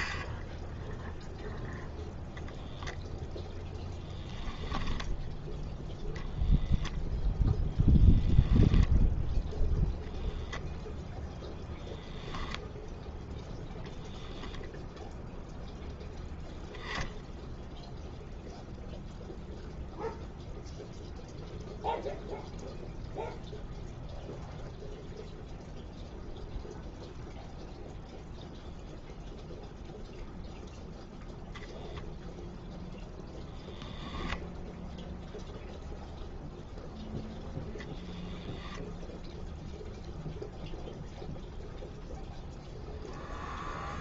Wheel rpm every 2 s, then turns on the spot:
0, 0, 10, 10, 0, 0, 0, 0, 0, 0, 0, 0, 0, 0, 0, 0, 0, 0, 0, 0, 0, 0.
none